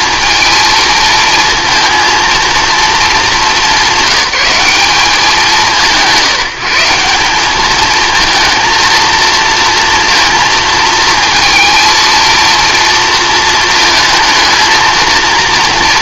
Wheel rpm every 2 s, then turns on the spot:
230, 230, 190, 170, 230, 230, 230, 220.
none